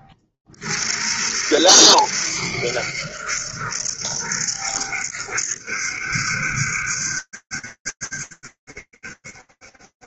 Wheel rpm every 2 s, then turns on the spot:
20, 70, 70, 70, 70.
none